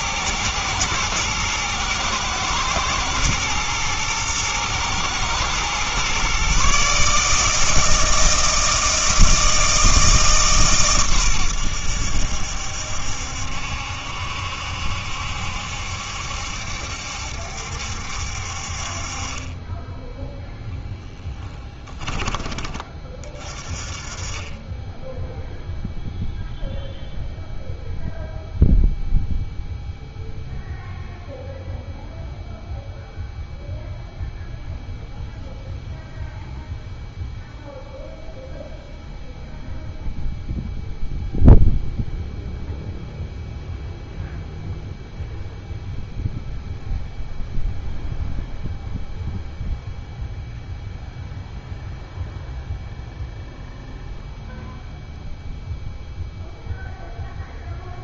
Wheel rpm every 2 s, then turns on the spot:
110, 110, 120, 140, 160, 140, 70, 70, 70, 50, 0, 20, 20, 0, 0, 0, 0, 0, 0, 0, 0, 0, 0, 0, 0, 0, 0, 0, 0.
none